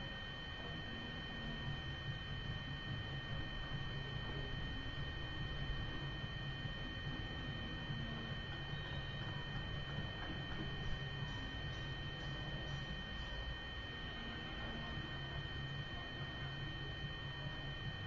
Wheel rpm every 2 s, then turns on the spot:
0, 0, 0, 0, 0, 0, 0, 0, 0.
none